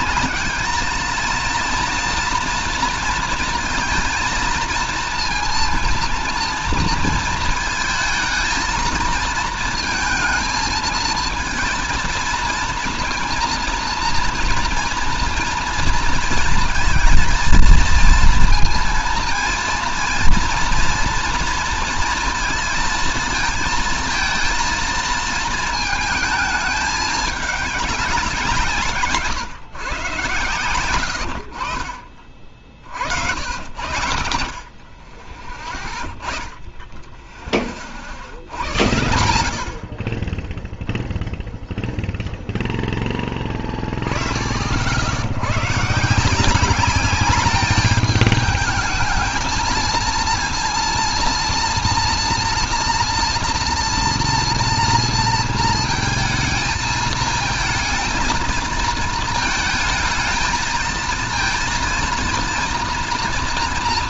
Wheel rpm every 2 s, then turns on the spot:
220, 230, 230, 230, 220, 220, 230, 240, 230, 230, 230, 230, 230, 220, 160, 110, 60, 50, 0, 80, 10, 10, 60, 200, 220, 230, 230, 230, 220, 230, 220, 230.
none